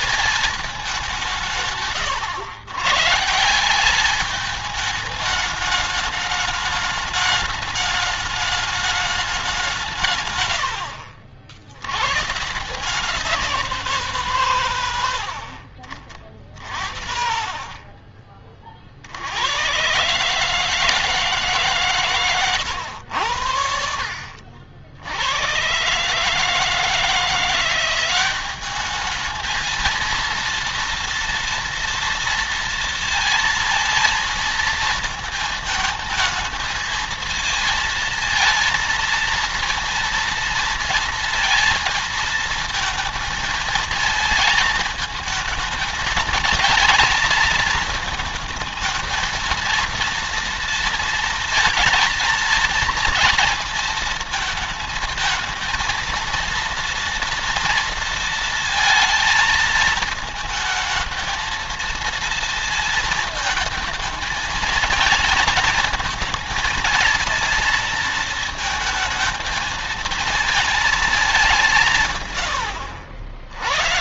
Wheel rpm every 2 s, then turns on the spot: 170, 150, 210, 210, 190, 60, 190, 60, 50, 80, 150, 90, 90, 170, 220, 230, 230, 220, 230, 230, 230, 220, 220, 220, 220, 230, 230, 230, 230, 230, 220, 220, 220, 220, 220, 210, 70.
none